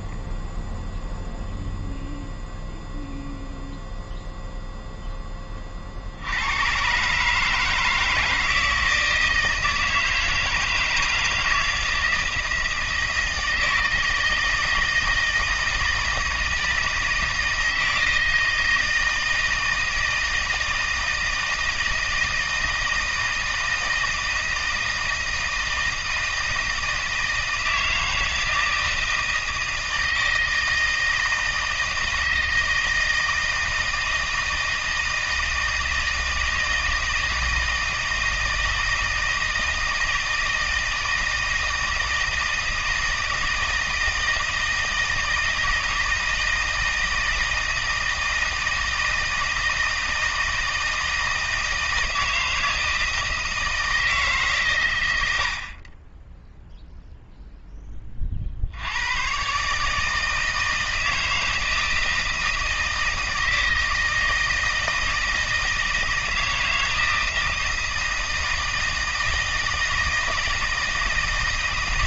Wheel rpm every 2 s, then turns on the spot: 0, 0, 0, 130, 160, 160, 160, 160, 160, 160, 160, 160, 160, 160, 160, 160, 160, 160, 160, 160, 160, 160, 160, 160, 160, 160, 160, 120, 0, 70, 160, 160, 160, 160, 160, 160.
none